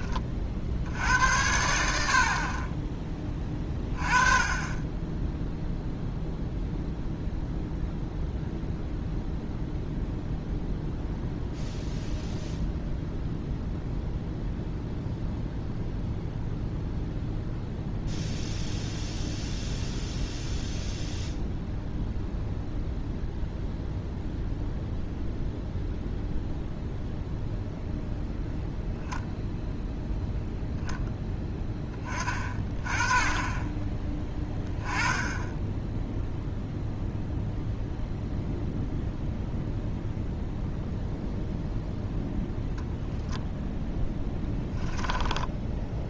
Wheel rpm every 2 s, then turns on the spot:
60, 30, 20, 0, 0, 0, 0, 0, 0, 0, 0, 0, 0, 0, 0, 0, 20, 10, 0, 0, 0, 0, 10.
44-46